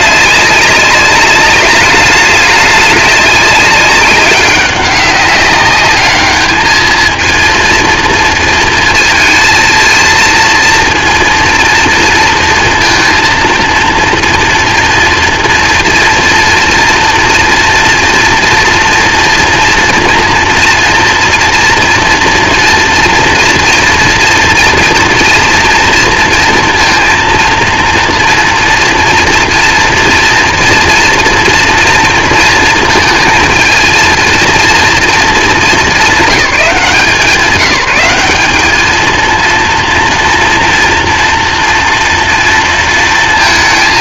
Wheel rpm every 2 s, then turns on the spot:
200, 200, 200, 220, 230, 230, 230, 230, 230, 230, 230, 230, 230, 230, 230, 240, 230, 230, 180, 220, 230, 230.
none